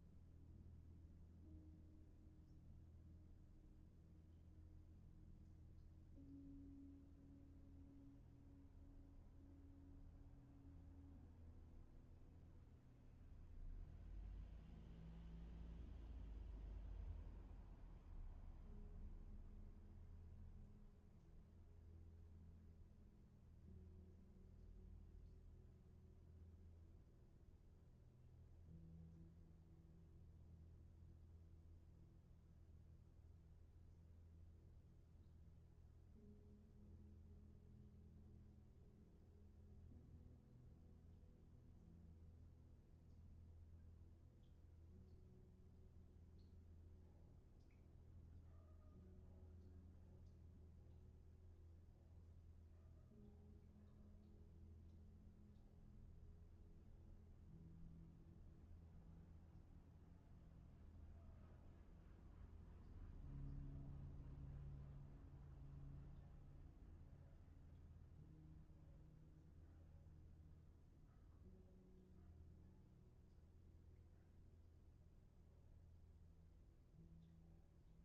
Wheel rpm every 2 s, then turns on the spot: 0, 0, 0, 0, 0, 0, 0, 0, 0, 0, 0, 0, 0, 0, 0, 0, 0, 0, 0, 0, 0, 0, 0, 0, 0, 0, 0, 0, 0, 0, 0, 0, 0, 0, 0, 0, 0, 0, 0.
none